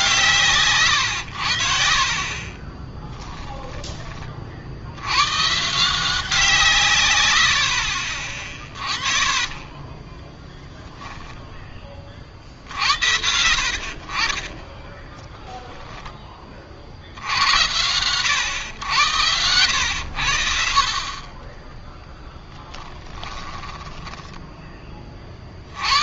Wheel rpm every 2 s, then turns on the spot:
140, 30, 70, 150, 30, 10, 70, 10, 50, 110, 40, 10, 20.
2-4 8-10 14-16 22-24